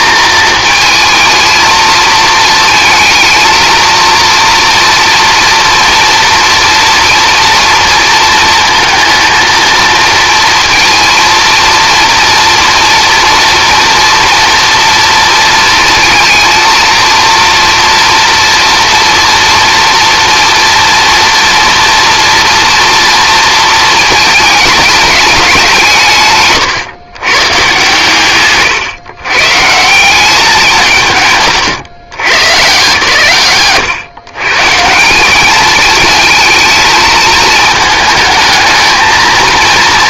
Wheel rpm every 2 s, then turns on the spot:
220, 220, 230, 240, 230, 230, 230, 230, 230, 230, 230, 230, 210, 160, 150, 180, 150, 150, 220, 220.
26-28